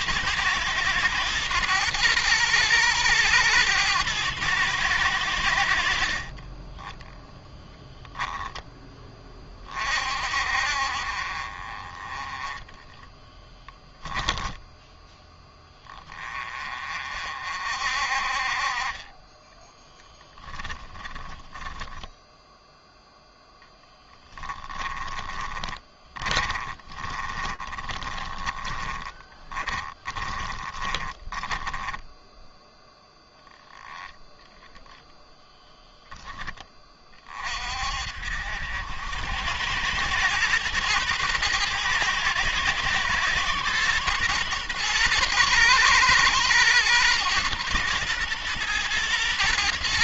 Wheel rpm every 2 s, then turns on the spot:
120, 110, 110, 10, 20, 50, 10, 10, 30, 30, 10, 10, 20, 30, 20, 20, 0, 10, 20, 80, 120, 110, 120, 120, 120.
12-14 24-32